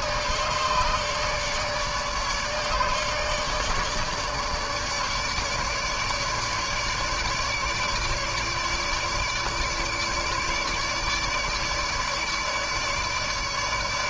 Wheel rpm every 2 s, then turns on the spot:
150, 150, 150, 150, 150, 150, 150.
none